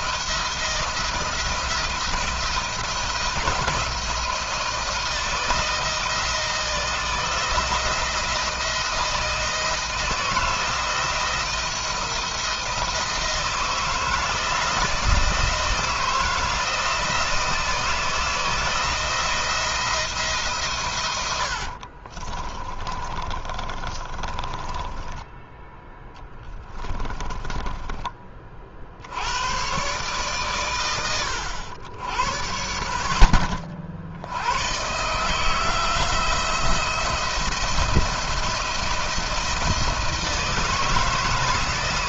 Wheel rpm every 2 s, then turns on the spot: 170, 170, 160, 160, 170, 170, 160, 170, 160, 170, 130, 20, 20, 20, 50, 120, 100, 120, 170, 170, 160.
22-28